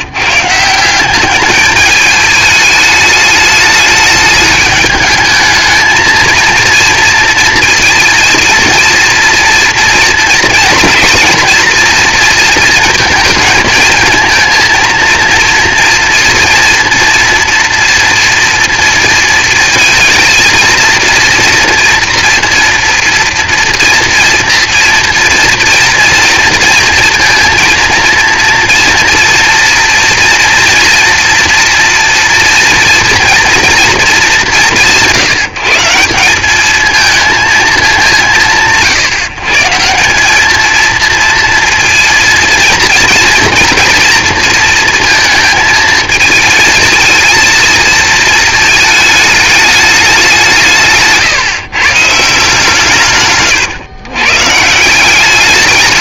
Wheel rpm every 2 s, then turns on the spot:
150, 210, 210, 230, 230, 240, 230, 230, 230, 230, 230, 240, 230, 240, 230, 240, 230, 190, 200, 160, 210, 230, 230, 220, 220, 170, 160, 140.
none